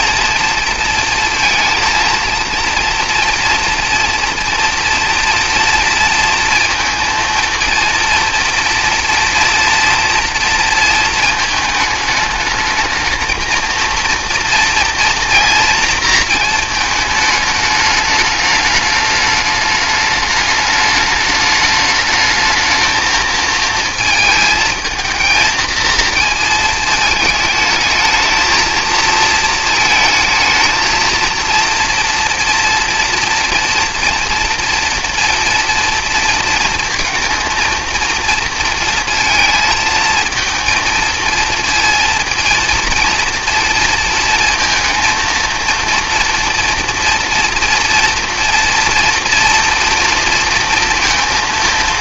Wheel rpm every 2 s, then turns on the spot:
230, 230, 230, 230, 230, 230, 220, 230, 220, 210, 210, 220, 220, 220, 230, 220, 240, 230, 230, 230, 220, 230, 230, 230, 240, 230.
none